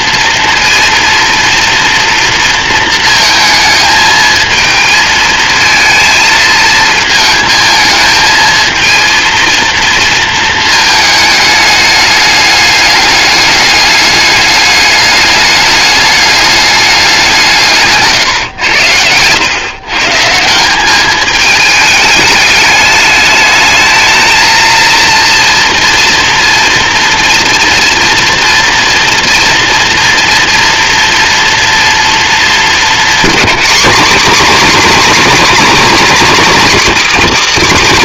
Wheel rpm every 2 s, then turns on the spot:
230, 220, 220, 220, 230, 210, 200, 210, 160, 110, 210, 220, 230, 230, 230, 230, 230, 260, 250.
none